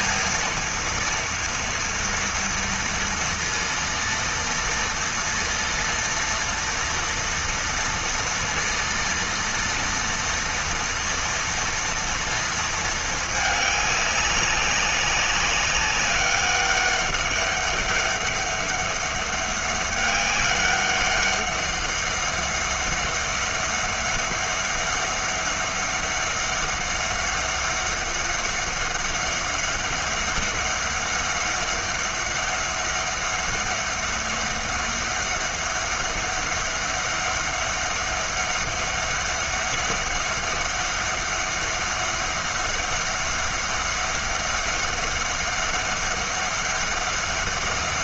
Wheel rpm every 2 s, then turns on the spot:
230, 230, 230, 230, 230, 230, 220, 200, 200, 200, 200, 200, 200, 200, 200, 200, 200, 200, 200, 200, 200, 200, 200, 200.
none